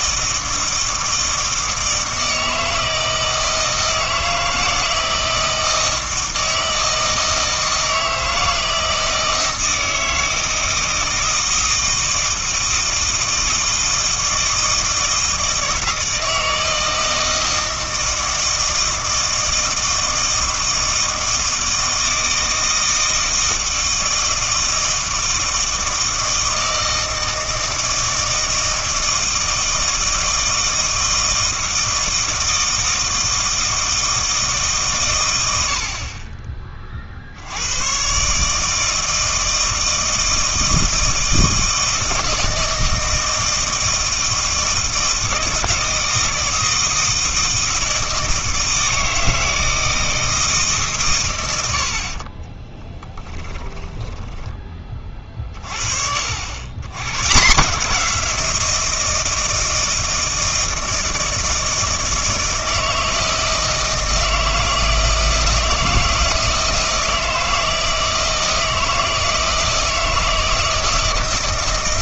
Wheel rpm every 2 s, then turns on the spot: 160, 160, 160, 160, 160, 160, 160, 160, 160, 160, 160, 160, 160, 160, 160, 160, 160, 150, 20, 150, 170, 160, 160, 160, 160, 150, 20, 20, 80, 170, 160, 160, 160, 160, 160, 160.
52-54